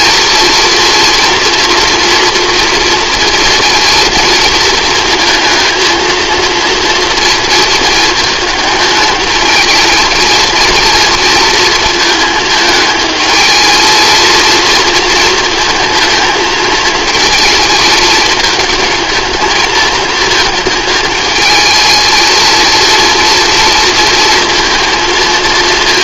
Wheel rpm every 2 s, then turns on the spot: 230, 230, 230, 240, 220, 230, 220, 230, 220, 220, 220, 230, 230.
none